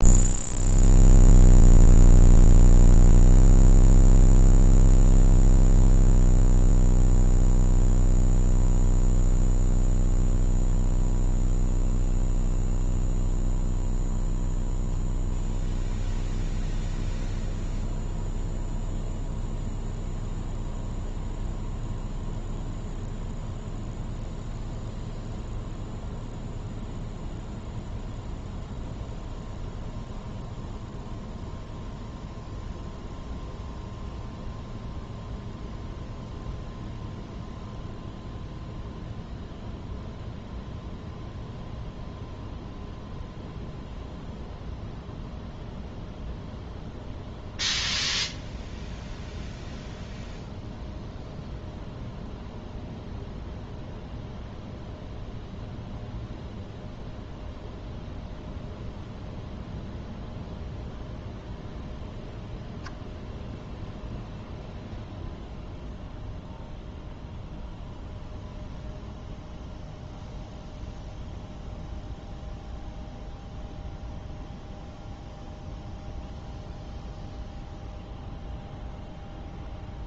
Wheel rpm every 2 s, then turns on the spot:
0, 0, 0, 0, 0, 0, 0, 0, 0, 0, 0, 0, 0, 0, 0, 0, 0, 0, 0, 0, 0, 0, 0, 0, 0, 0, 0, 0, 0, 0, 0, 0, 0, 0, 0, 0, 0, 0, 0, 0.
none